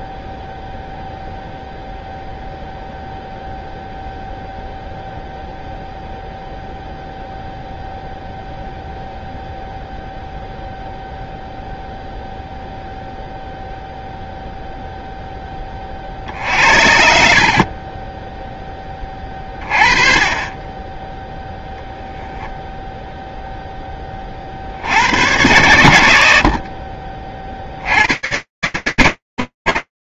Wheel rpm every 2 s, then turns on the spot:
0, 0, 0, 0, 0, 0, 0, 0, 60, 20, 20, 0, 70, 50, 140.
none